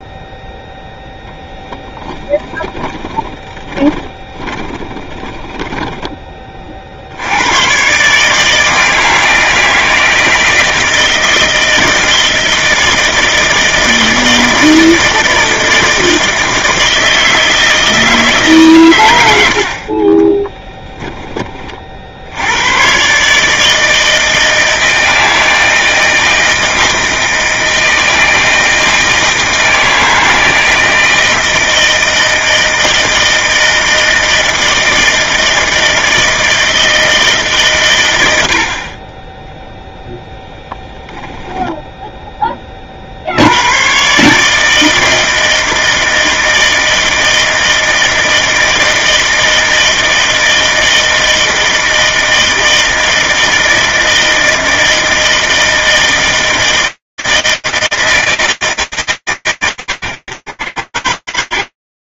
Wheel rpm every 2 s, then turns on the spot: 0, 20, 20, 20, 150, 160, 160, 160, 160, 160, 20, 60, 160, 160, 160, 160, 160, 160, 160, 110, 0, 10, 130, 160, 160, 160, 160, 160, 160, 140, 100.
2-6 20-22